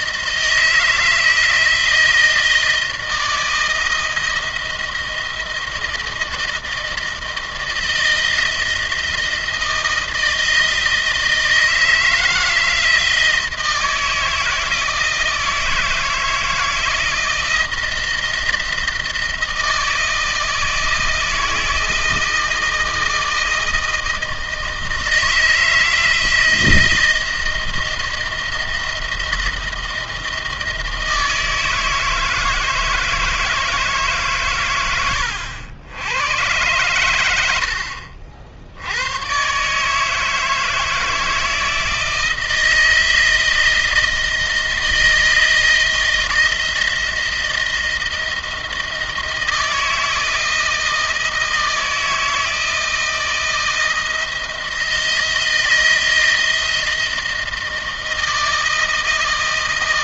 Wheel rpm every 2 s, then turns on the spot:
160, 160, 160, 160, 160, 160, 160, 160, 160, 160, 160, 160, 160, 170, 170, 160, 160, 110, 100, 80, 160, 160, 160, 160, 160, 160, 160, 160, 160, 160.
none